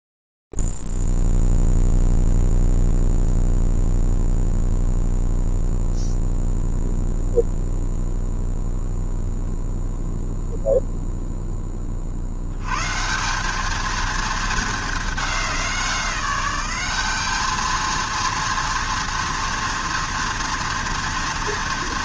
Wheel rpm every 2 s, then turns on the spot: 0, 0, 0, 0, 0, 0, 80, 220, 190, 230, 230.
none